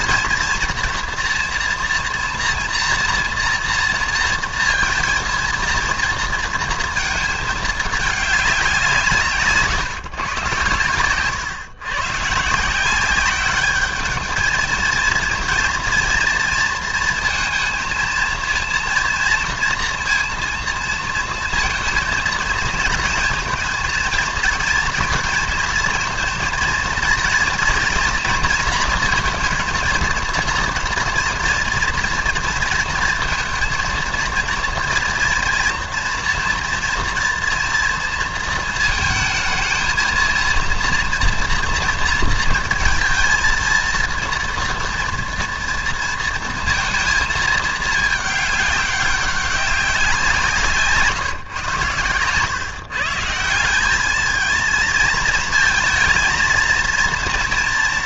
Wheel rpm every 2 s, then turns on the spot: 230, 230, 230, 230, 200, 130, 150, 220, 230, 230, 230, 230, 230, 230, 230, 230, 230, 240, 230, 230, 230, 230, 230, 230, 200, 160, 130, 220, 230.
none